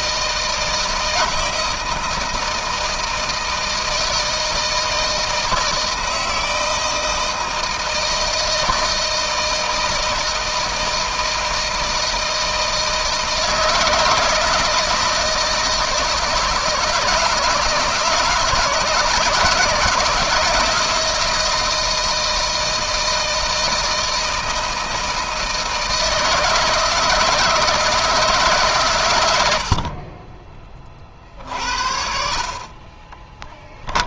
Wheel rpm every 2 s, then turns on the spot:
160, 160, 160, 160, 160, 160, 160, 170, 160, 170, 170, 160, 160, 160, 100, 40, 20.
32-34